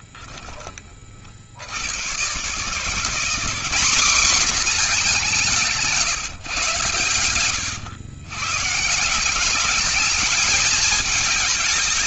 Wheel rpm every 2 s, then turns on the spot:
30, 130, 230, 130, 140, 220.
none